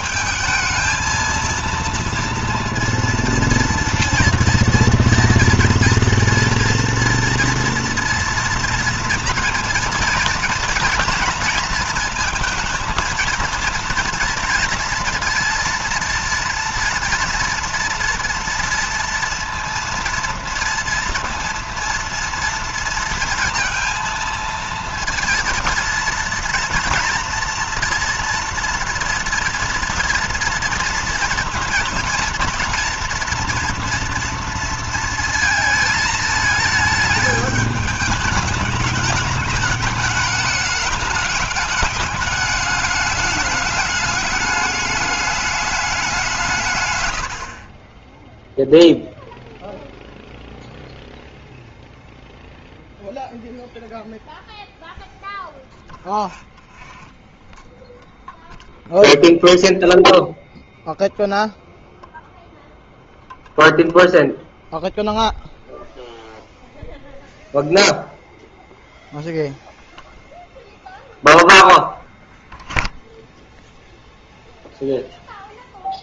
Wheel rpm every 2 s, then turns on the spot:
220, 230, 230, 230, 240, 240, 230, 230, 230, 230, 230, 230, 230, 230, 230, 230, 230, 230, 220, 210, 210, 200, 210, 140, 0, 0, 0, 0, 0, 0, 0, 0, 0, 0, 0, 0, 0, 0.
none